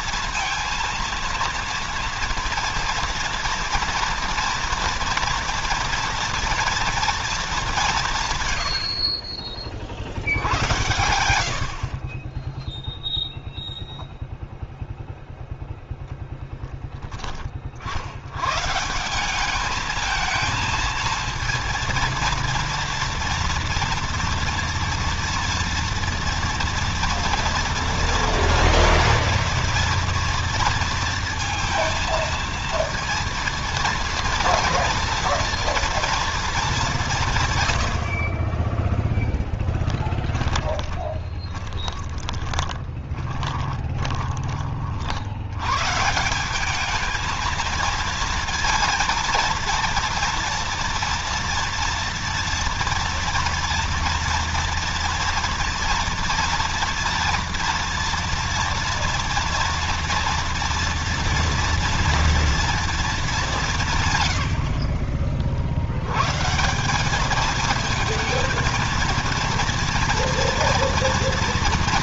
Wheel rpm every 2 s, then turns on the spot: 230, 230, 230, 230, 80, 90, 10, 0, 10, 110, 220, 230, 230, 240, 230, 230, 230, 230, 210, 10, 20, 20, 40, 200, 230, 230, 230, 230, 240, 230, 230, 230, 70, 170, 230, 230.
38-44